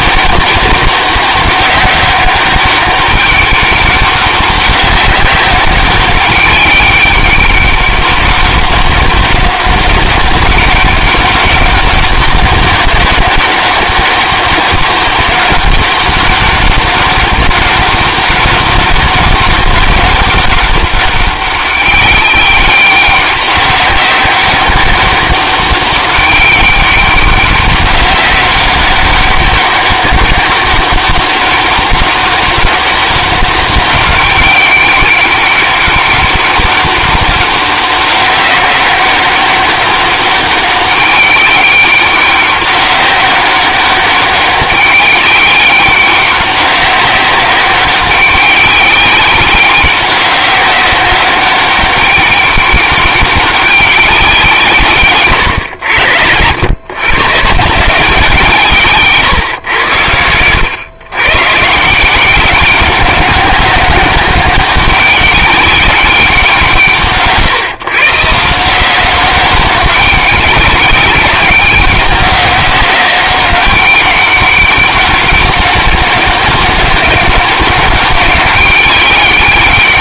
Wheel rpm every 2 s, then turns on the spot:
200, 200, 190, 200, 200, 200, 200, 200, 200, 190, 200, 200, 200, 200, 190, 200, 200, 200, 200, 190, 200, 200, 200, 190, 190, 190, 200, 150, 110, 140, 110, 190, 200, 150, 180, 190, 190, 200, 200, 200.
none